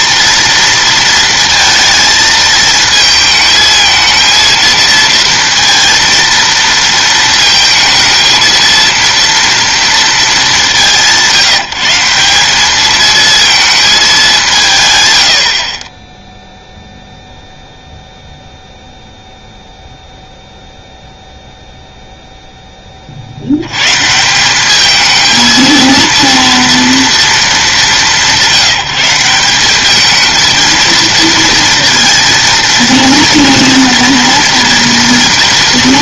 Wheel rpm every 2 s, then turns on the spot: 230, 220, 230, 230, 230, 210, 200, 160, 0, 0, 0, 10, 190, 230, 180, 220, 230, 230.
none